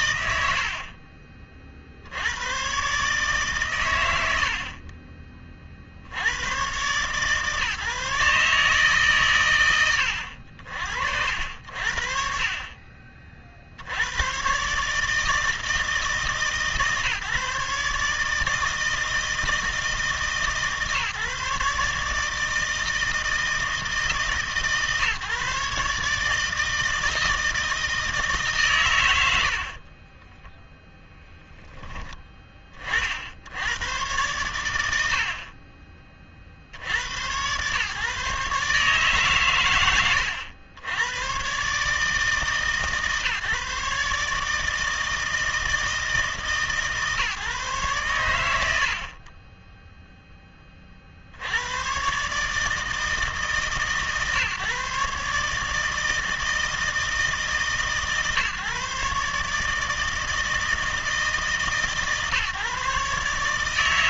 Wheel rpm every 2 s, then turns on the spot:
90, 130, 50, 120, 150, 60, 40, 140, 140, 160, 150, 160, 150, 160, 140, 10, 30, 100, 80, 140, 80, 150, 160, 150, 90, 20, 150, 140, 160, 150, 160, 140.
none